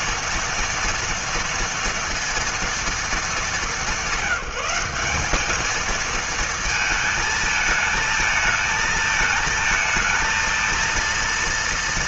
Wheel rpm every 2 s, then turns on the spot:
230, 230, 190, 220, 220, 230.
none